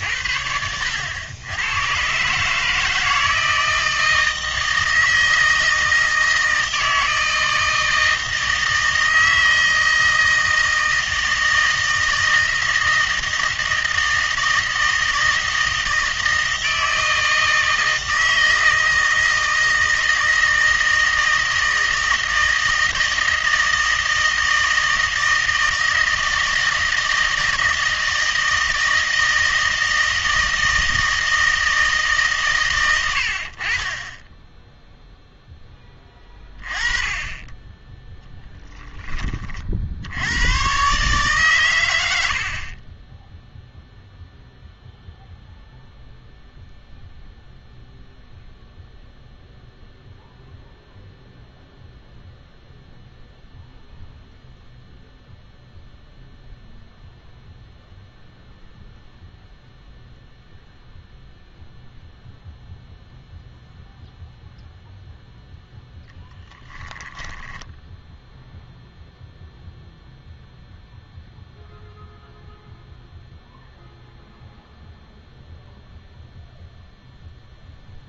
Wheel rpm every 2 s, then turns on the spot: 80, 160, 160, 160, 160, 160, 160, 160, 160, 160, 160, 160, 160, 160, 160, 160, 110, 0, 20, 10, 120, 40, 0, 0, 0, 0, 0, 0, 0, 0, 0, 0, 0, 10, 0, 0, 0, 0, 0.
66-68